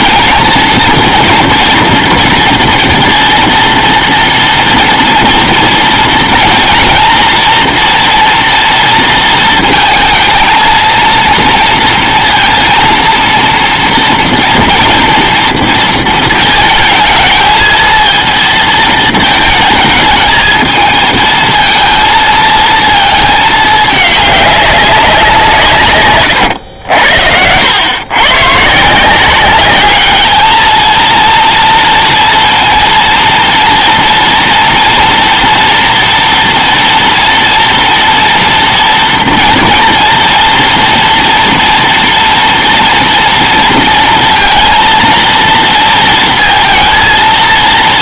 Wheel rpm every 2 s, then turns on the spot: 230, 230, 230, 230, 230, 220, 230, 240, 220, 230, 220, 230, 210, 120, 130, 220, 230, 240, 230, 230, 230, 240, 230, 230.
26-28